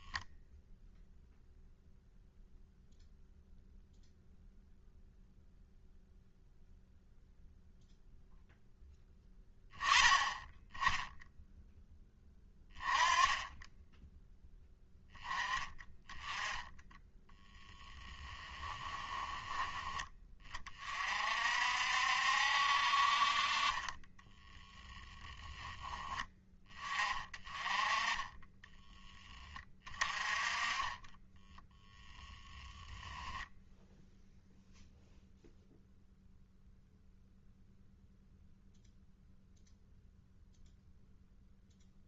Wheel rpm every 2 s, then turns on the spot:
0, 0, 0, 0, 10, 10, 20, 10, 10, 10, 40, 50, 10, 20, 30, 30, 10, 0, 0, 0, 0.
30-34